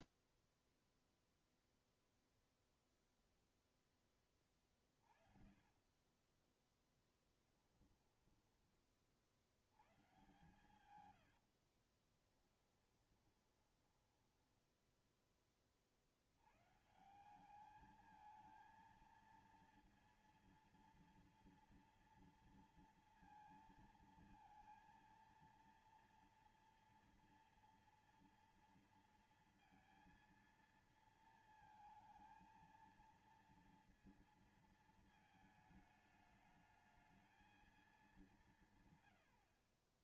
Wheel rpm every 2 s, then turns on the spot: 0, 0, 20, 30, 10, 130, 40, 10, 90, 220, 230, 230, 230, 230, 230, 230, 230, 230, 220, 200.
4-8 12-16